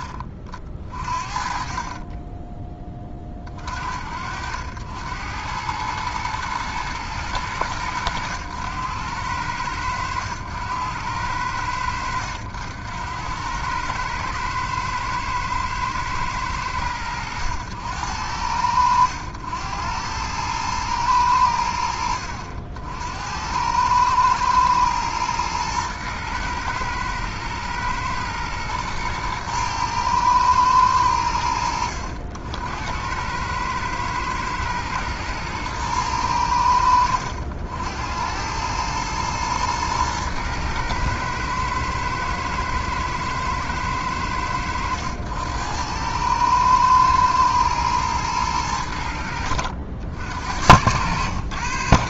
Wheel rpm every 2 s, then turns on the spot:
40, 30, 80, 110, 90, 90, 80, 110, 90, 90, 110, 60, 110, 110, 120, 110, 80, 110, 80, 100, 110, 110, 90, 110, 100, 70.
none